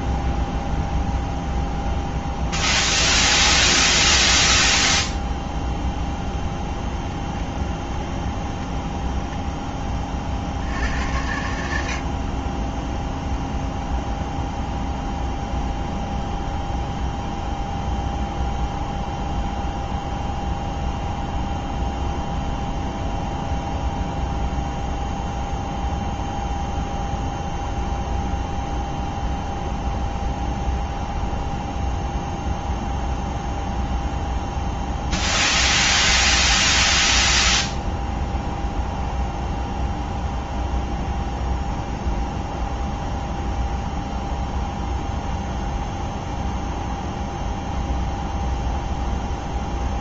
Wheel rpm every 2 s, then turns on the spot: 0, 0, 0, 0, 10, 70, 0, 0, 0, 0, 0, 0, 0, 0, 0, 0, 0, 0, 0, 0, 0, 0, 0, 0, 0.
none